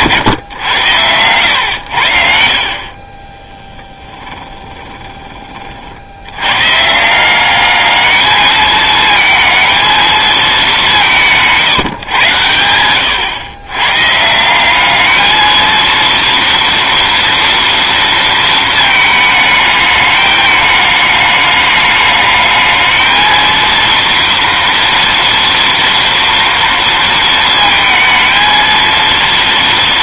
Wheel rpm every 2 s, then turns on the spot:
110, 40, 20, 140, 220, 190, 110, 190, 230, 220, 210, 220, 240, 230, 230.
4-6